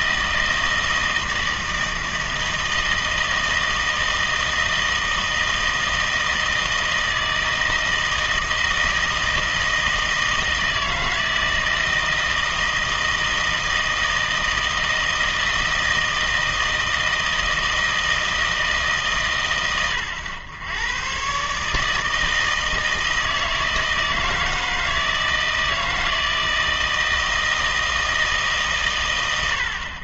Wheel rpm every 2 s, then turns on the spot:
160, 160, 160, 160, 160, 160, 160, 160, 160, 150, 110, 160, 160, 160, 150.
none